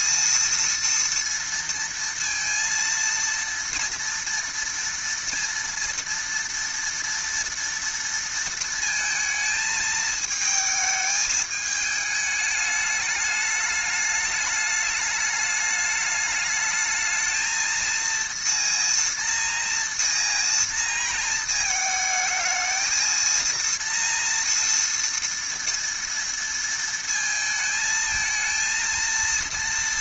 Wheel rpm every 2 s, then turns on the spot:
230, 230, 230, 230, 230, 220, 210, 210, 210, 230, 230, 220, 230, 230, 230.
none